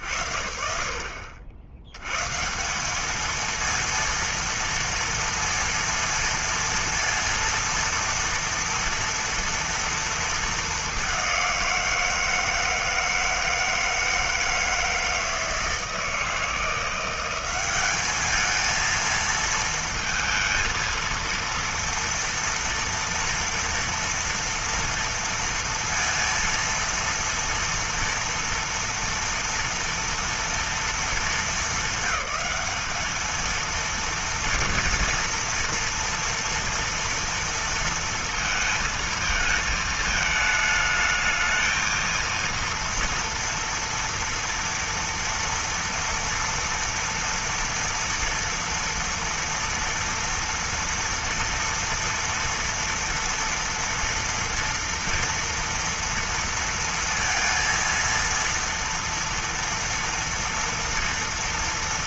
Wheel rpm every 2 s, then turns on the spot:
70, 190, 230, 230, 240, 210, 160, 160, 170, 220, 230, 240, 230, 230, 230, 230, 210, 230, 230, 220, 220, 230, 230, 230, 230, 240, 230, 230, 230, 230, 230.
none